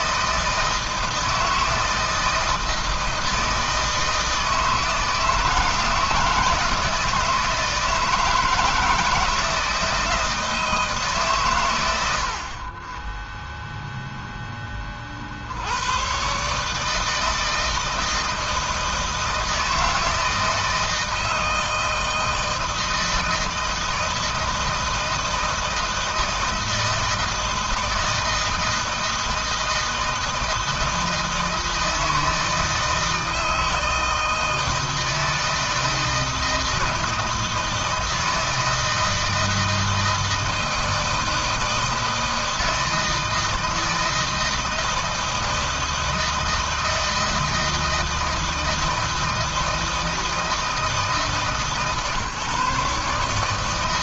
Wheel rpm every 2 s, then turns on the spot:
160, 160, 160, 160, 160, 160, 40, 10, 140, 160, 160, 160, 160, 160, 160, 160, 160, 160, 160, 160, 160, 160, 160, 160, 160, 160, 150.
none